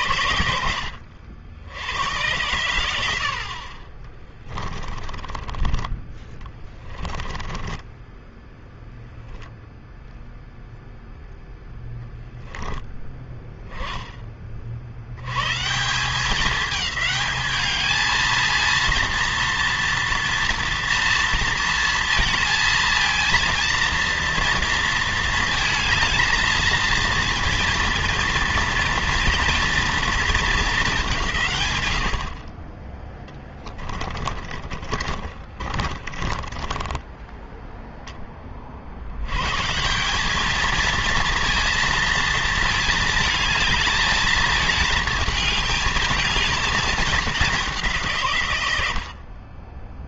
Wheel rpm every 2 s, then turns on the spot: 70, 70, 20, 10, 0, 0, 10, 70, 210, 230, 230, 230, 230, 230, 230, 200, 20, 30, 10, 70, 230, 220, 220, 220, 80.
4-8 34-38